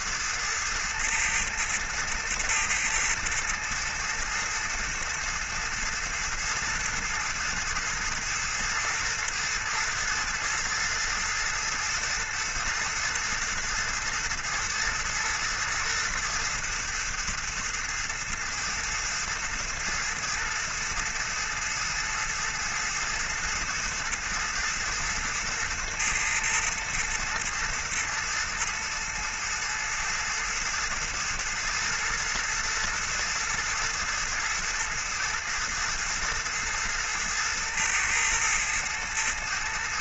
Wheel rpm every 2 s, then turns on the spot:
110, 110, 110, 110, 110, 110, 110, 120, 110, 110, 110, 110, 110, 110, 110, 110, 110, 110, 110, 110.
none